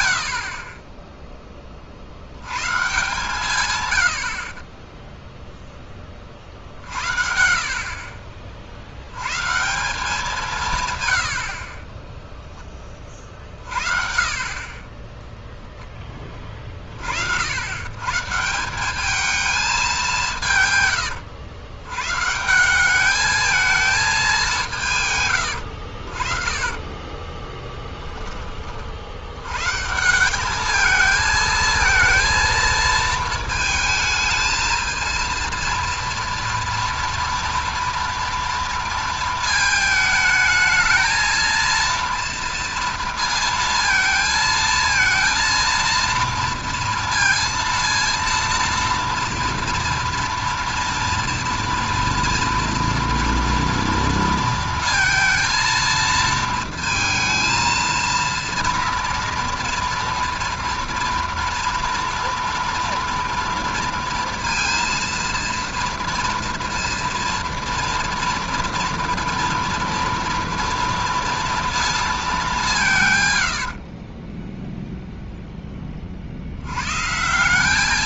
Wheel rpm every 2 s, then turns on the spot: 30, 130, 20, 60, 60, 150, 20, 30, 40, 190, 130, 180, 170, 30, 40, 220, 220, 220, 230, 230, 220, 230, 220, 230, 230, 230, 230, 230, 230, 230, 230, 230, 230, 230, 230, 230, 180, 0, 110.
14-16 26-28